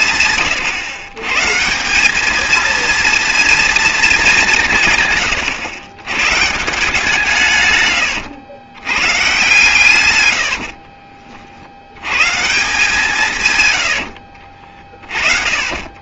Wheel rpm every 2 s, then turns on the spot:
130, 220, 160, 160, 100, 60, 170, 40.
10-12 14-16